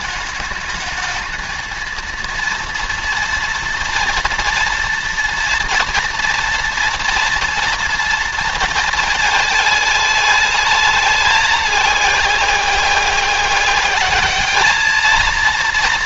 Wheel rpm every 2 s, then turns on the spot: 210, 230, 240, 230, 230, 210, 190, 210.
none